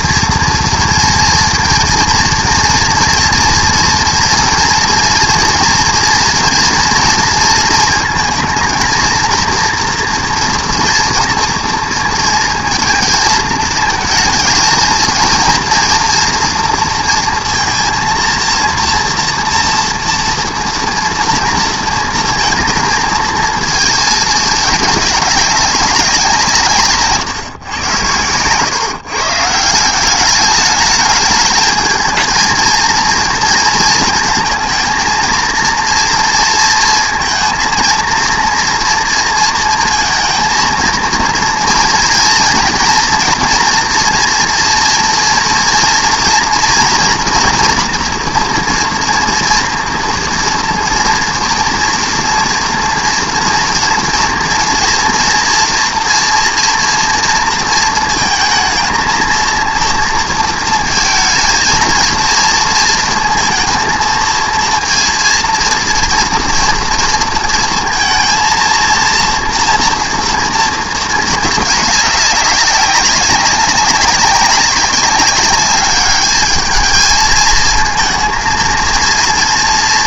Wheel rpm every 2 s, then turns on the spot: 230, 230, 230, 230, 220, 230, 230, 230, 240, 230, 230, 230, 210, 150, 120, 210, 230, 220, 230, 240, 230, 240, 230, 230, 240, 230, 230, 240, 240, 220, 220, 230, 230, 230, 230, 230, 200, 200, 210, 230.
none